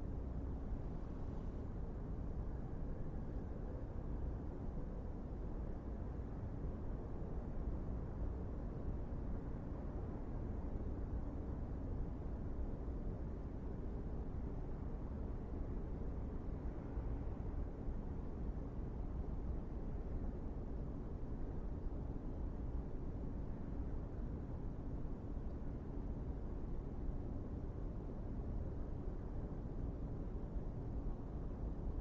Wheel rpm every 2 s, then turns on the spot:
0, 0, 0, 0, 0, 0, 0, 0, 0, 0, 0, 0, 0, 0, 0, 0.
none